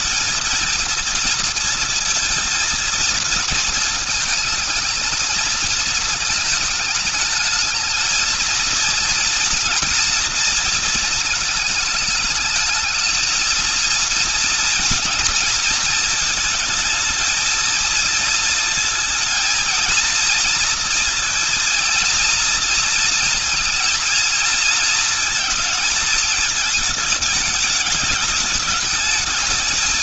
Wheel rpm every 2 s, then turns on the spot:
230, 230, 220, 210, 230, 220, 220, 230, 220, 220, 230, 230, 230, 210, 220.
none